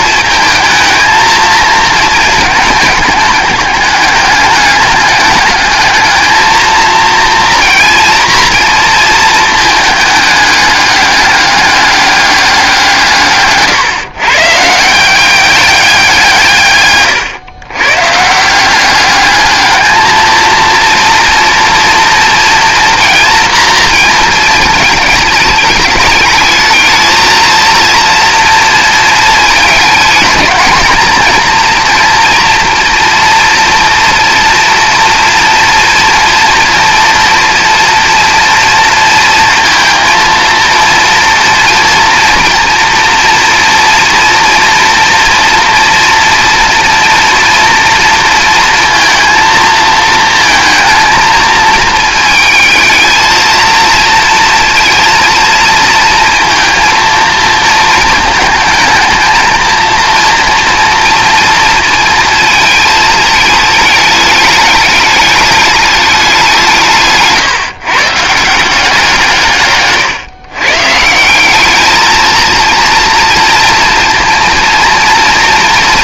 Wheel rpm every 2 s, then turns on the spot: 220, 210, 200, 230, 230, 210, 180, 160, 130, 190, 230, 230, 220, 220, 230, 230, 230, 240, 230, 230, 230, 230, 230, 240, 230, 230, 220, 230, 230, 220, 230, 220, 210, 170, 170, 130, 230, 230.
none